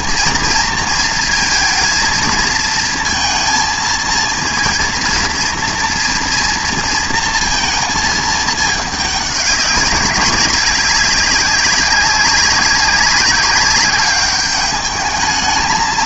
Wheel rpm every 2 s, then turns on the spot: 230, 220, 230, 240, 210, 190, 190, 200.
none